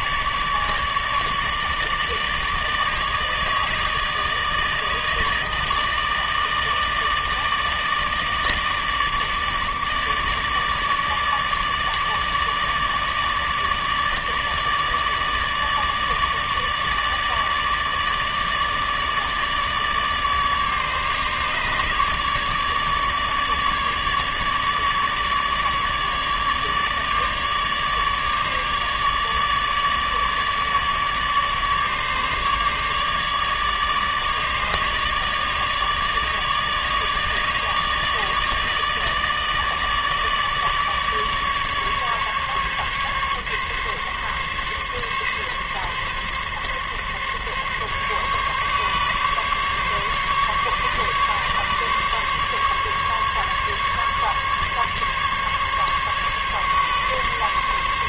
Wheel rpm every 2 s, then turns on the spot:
150, 150, 150, 150, 150, 150, 150, 150, 150, 150, 150, 150, 150, 150, 150, 150, 150, 150, 150, 150, 150, 140, 140, 140, 140, 140, 140, 140, 140.
none